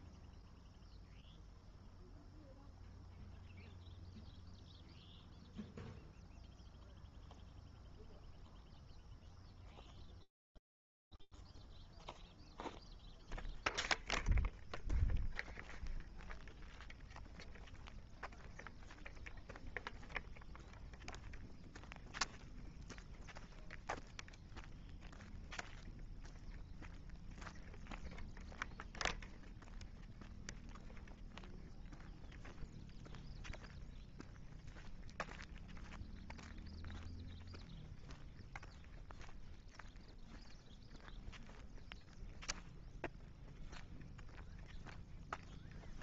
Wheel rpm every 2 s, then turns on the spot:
0, 0, 0, 0, 0, 0, 0, 0, 0, 0, 0, 0, 0, 0, 0, 0, 0, 0, 0, 0, 0, 0, 0.
none